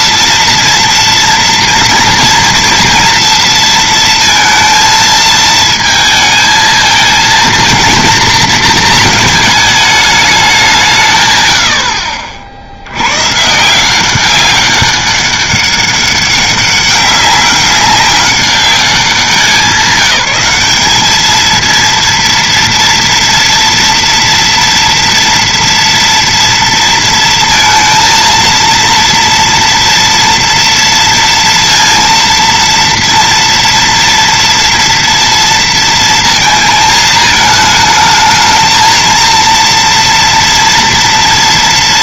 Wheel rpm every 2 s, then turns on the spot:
230, 230, 230, 220, 230, 190, 80, 200, 200, 190, 200, 230, 230, 230, 230, 230, 230, 230, 230, 220, 230.
none